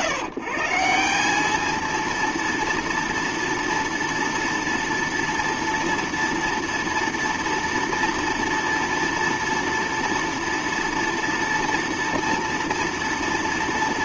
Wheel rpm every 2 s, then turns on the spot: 160, 230, 230, 230, 230, 230, 230.
none